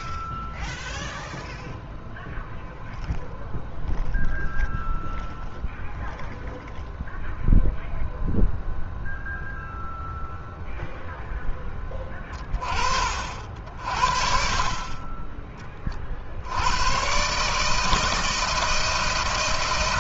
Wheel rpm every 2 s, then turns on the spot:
0, 0, 0, 0, 0, 0, 30, 40, 100, 160.
none